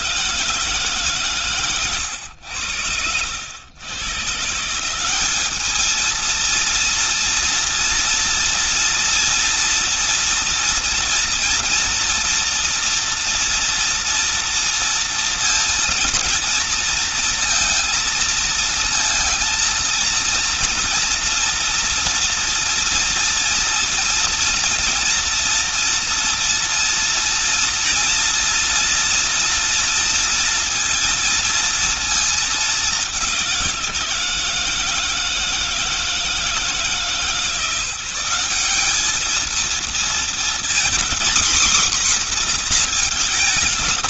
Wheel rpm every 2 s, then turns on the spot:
160, 90, 160, 230, 230, 230, 240, 240, 230, 230, 230, 230, 230, 230, 230, 230, 210, 160, 160, 200, 230, 240.
none